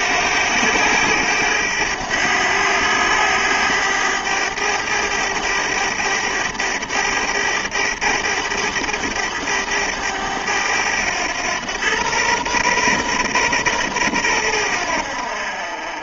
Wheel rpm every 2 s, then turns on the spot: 100, 100, 100, 100, 100, 100, 120, 80.
none